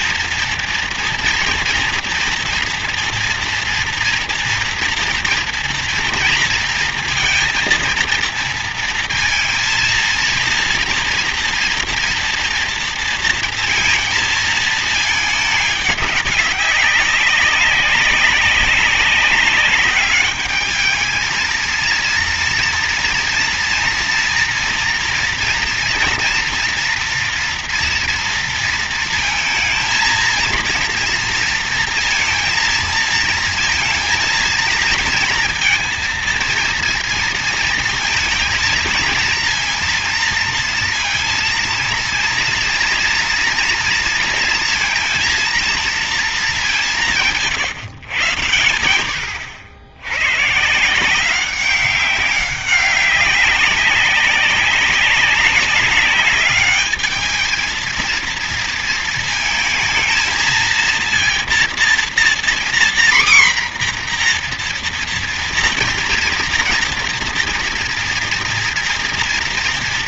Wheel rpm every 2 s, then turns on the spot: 230, 230, 230, 230, 230, 230, 240, 220, 200, 200, 210, 230, 230, 240, 230, 230, 230, 230, 230, 230, 230, 230, 230, 210, 110, 130, 190, 190, 200, 230, 220, 240, 240, 230, 230.
none